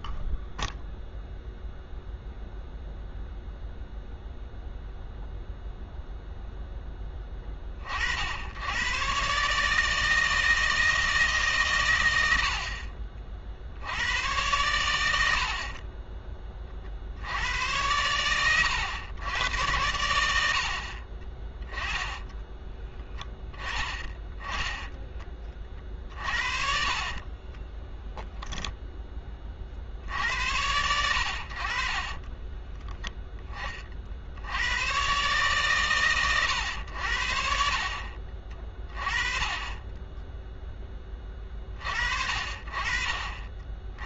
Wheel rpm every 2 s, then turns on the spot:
0, 0, 0, 10, 100, 160, 60, 90, 40, 110, 70, 10, 10, 40, 0, 80, 10, 90, 100, 30, 10, 40.
26-28 32-34